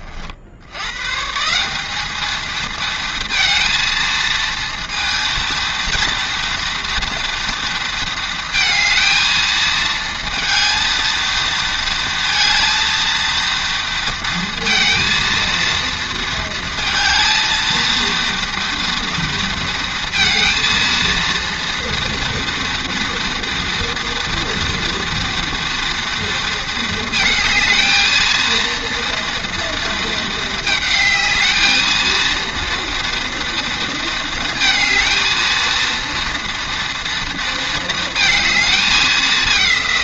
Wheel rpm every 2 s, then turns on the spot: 80, 220, 230, 230, 230, 230, 230, 230, 230, 230, 230, 230, 240, 230, 230, 220, 230, 230, 230, 220.
none